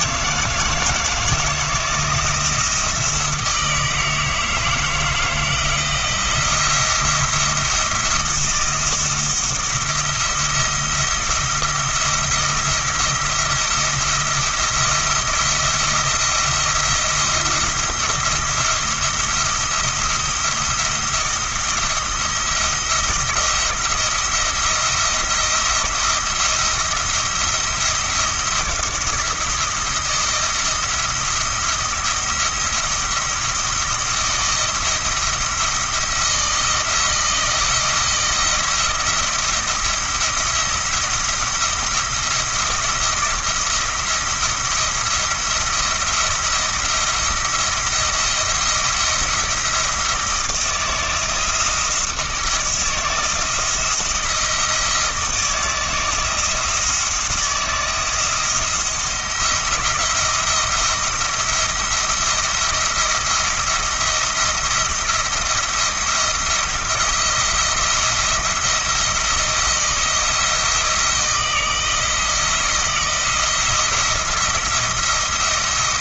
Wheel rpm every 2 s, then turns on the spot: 160, 160, 160, 170, 170, 170, 170, 170, 170, 170, 170, 170, 170, 170, 170, 170, 170, 170, 170, 160, 170, 170, 170, 170, 170, 170, 160, 160, 160, 170, 170, 170, 170, 170, 170, 160, 160, 170.
none